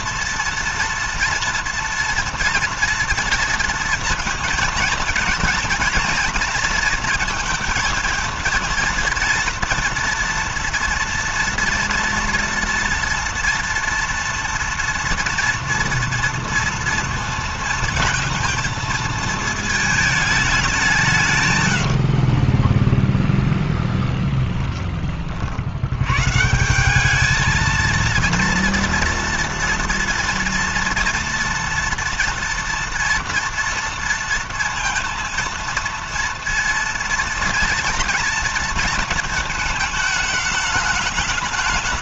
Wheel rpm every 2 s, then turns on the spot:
230, 230, 230, 230, 230, 230, 230, 230, 230, 230, 160, 10, 40, 200, 230, 230, 230, 230, 230, 230, 210.
none